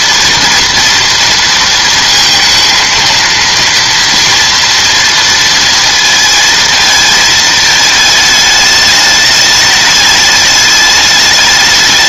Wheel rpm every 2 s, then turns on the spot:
230, 230, 230, 220, 210, 210.
none